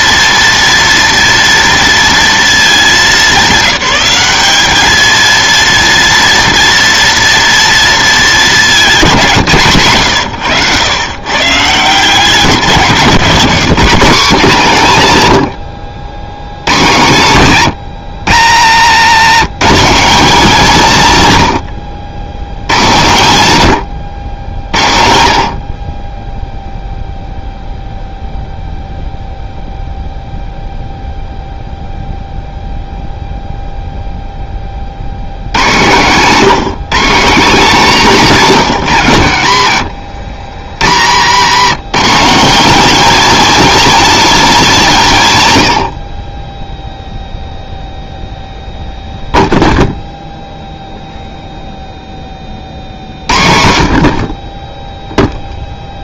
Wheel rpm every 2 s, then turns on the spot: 230, 220, 210, 230, 200, 110, 170, 170, 100, 100, 210, 100, 70, 0, 0, 0, 0, 30, 180, 180, 70, 220, 230, 10, 0, 0, 40, 20.
18-20